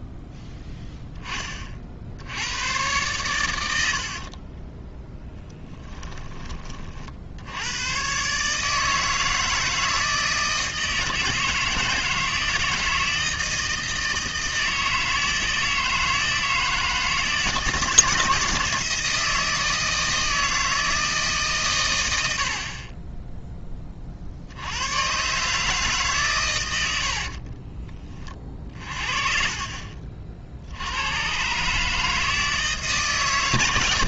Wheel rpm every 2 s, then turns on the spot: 10, 110, 10, 30, 150, 160, 160, 160, 160, 160, 160, 30, 100, 90, 50, 80, 150.
4-6